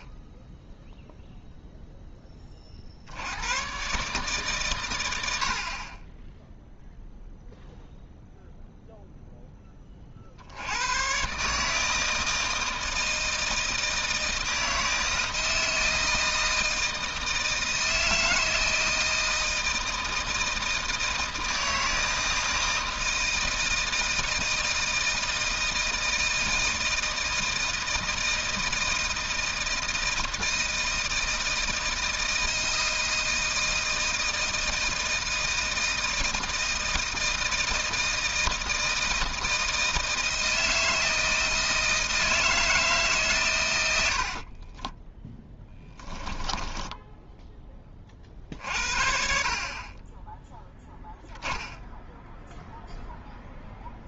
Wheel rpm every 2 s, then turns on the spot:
0, 40, 120, 0, 0, 90, 160, 160, 160, 160, 160, 160, 160, 160, 170, 160, 160, 160, 160, 160, 160, 160, 30, 10, 50, 0, 0.
44-48